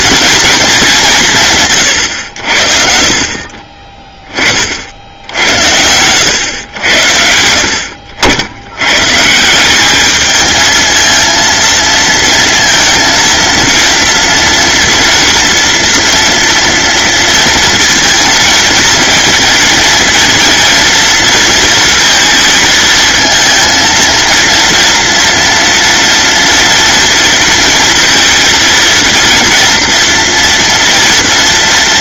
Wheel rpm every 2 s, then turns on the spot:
200, 50, 60, 100, 110, 220, 230, 230, 230, 230, 230, 230, 230, 240, 230, 230.
none